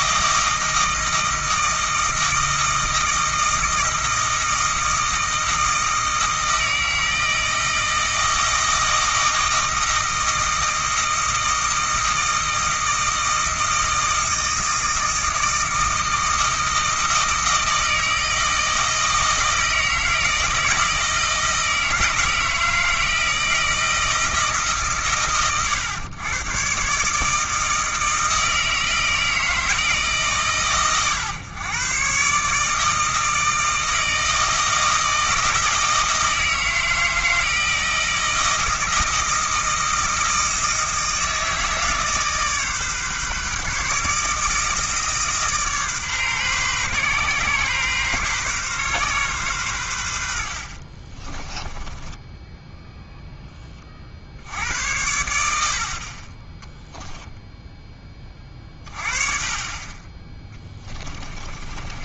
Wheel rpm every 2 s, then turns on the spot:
160, 160, 160, 160, 160, 160, 160, 160, 160, 160, 160, 160, 150, 130, 160, 130, 150, 160, 160, 160, 160, 140, 160, 130, 130, 50, 0, 80, 10, 30, 10.
60-62